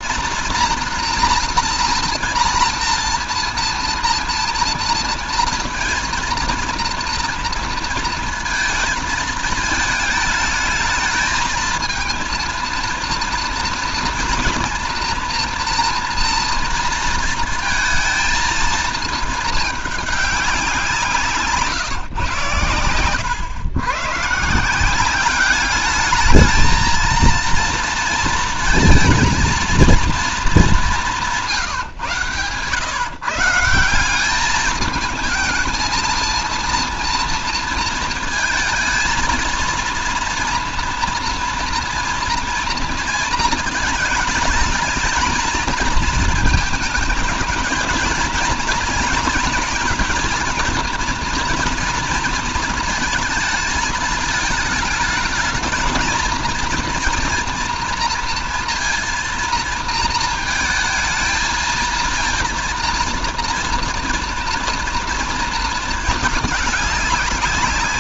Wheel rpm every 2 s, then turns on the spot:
230, 230, 230, 230, 230, 220, 230, 240, 230, 220, 200, 120, 150, 220, 230, 210, 120, 210, 230, 220, 230, 230, 220, 220, 230, 230, 230, 220, 230, 230, 230, 230, 240, 210.
none